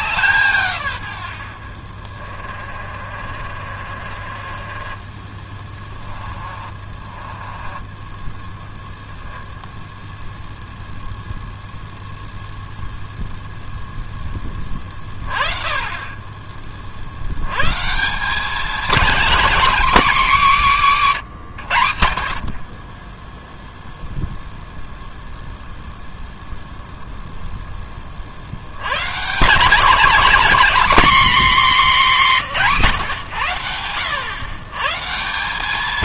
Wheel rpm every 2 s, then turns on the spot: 140, 40, 30, 30, 10, 0, 0, 20, 30, 210, 220, 40, 0, 10, 80, 240, 170, 120.
2-8